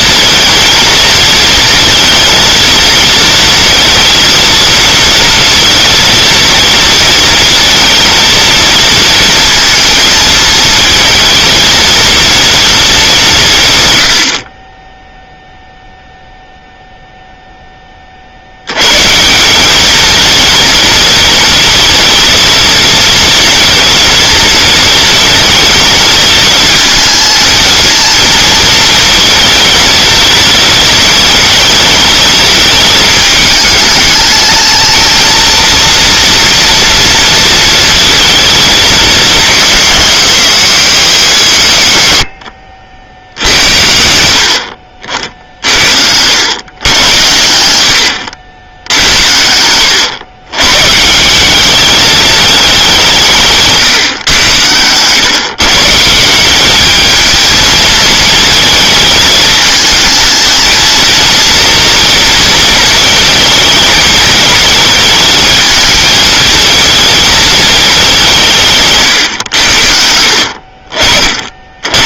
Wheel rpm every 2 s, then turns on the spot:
220, 230, 230, 230, 220, 230, 210, 10, 0, 120, 220, 230, 230, 230, 220, 220, 220, 220, 230, 220, 190, 80, 60, 110, 80, 140, 190, 110, 210, 220, 230, 220, 220, 220, 150, 50.
none